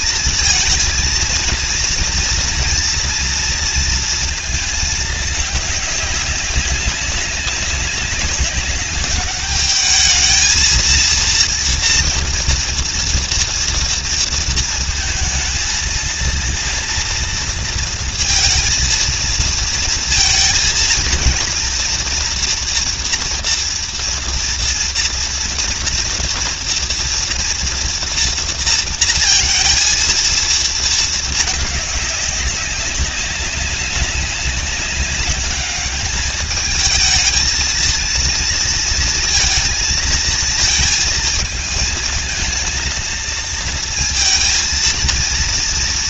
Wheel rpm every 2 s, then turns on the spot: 230, 230, 220, 200, 200, 220, 230, 230, 230, 230, 230, 230, 230, 230, 230, 220, 200, 190, 210, 230, 220, 220, 230.
none